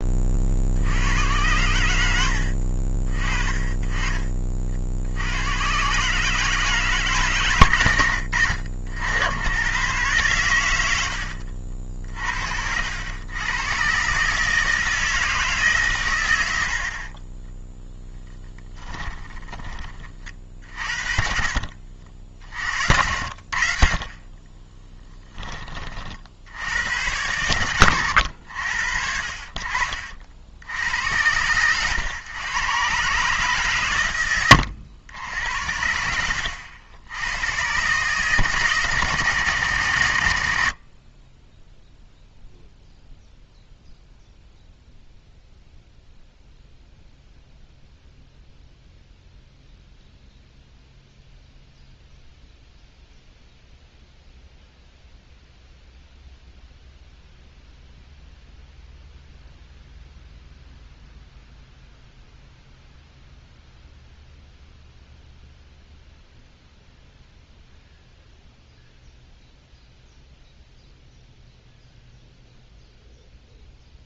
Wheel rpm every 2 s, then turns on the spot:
80, 30, 70, 150, 80, 80, 90, 160, 50, 10, 50, 70, 10, 100, 60, 90, 130, 90, 90, 130, 30, 0, 0, 0, 0, 0, 0, 0, 0, 0, 0, 0, 0, 0, 0, 0, 0.
16-20 22-24